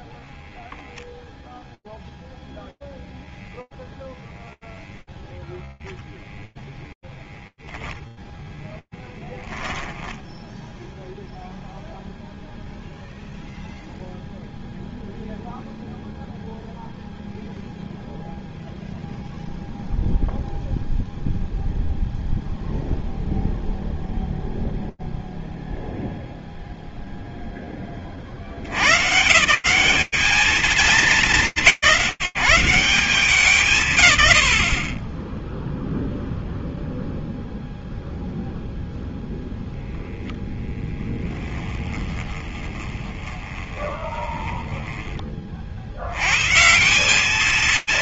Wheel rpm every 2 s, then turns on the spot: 0, 0, 0, 0, 0, 0, 0, 0, 0, 0, 0, 0, 60, 210, 140, 150, 0, 0, 0, 10, 20, 40, 210, 160.
38-42